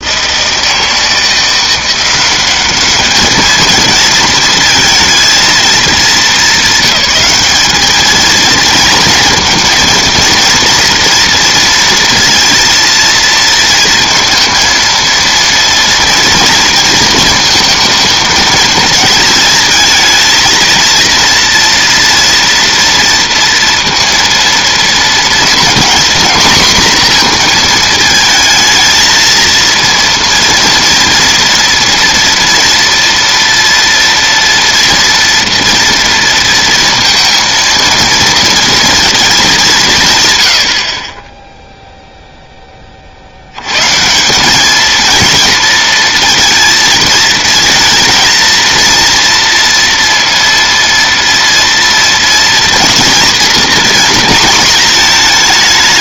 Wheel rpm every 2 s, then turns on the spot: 160, 200, 220, 210, 230, 230, 230, 230, 230, 220, 230, 230, 230, 240, 220, 230, 230, 230, 230, 230, 70, 20, 210, 230, 230, 230, 230, 220.
none